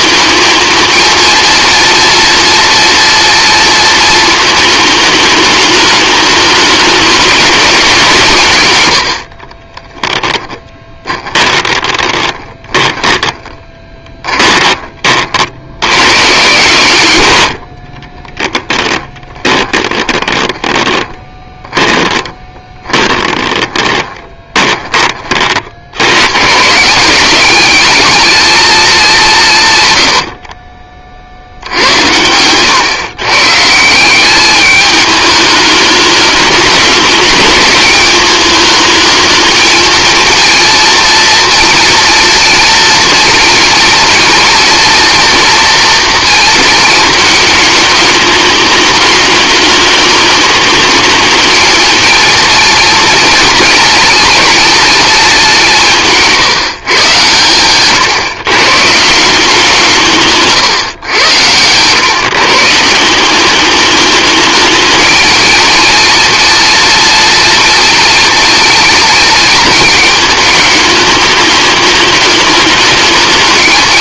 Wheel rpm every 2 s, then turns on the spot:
220, 230, 220, 210, 100, 20, 10, 30, 130, 10, 20, 20, 20, 160, 210, 50, 130, 210, 210, 220, 230, 230, 230, 230, 210, 210, 240, 230, 150, 160, 120, 160, 220, 240, 220, 210, 210.
10-14 18-24